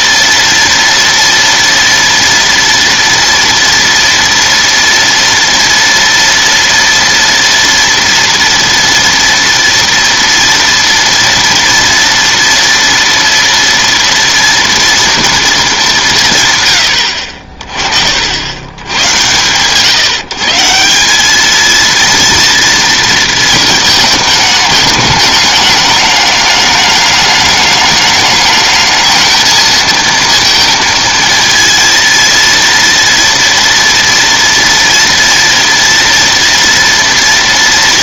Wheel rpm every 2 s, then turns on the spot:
230, 230, 230, 230, 230, 230, 230, 230, 160, 70, 150, 230, 220, 210, 210, 230, 230, 230, 230.
none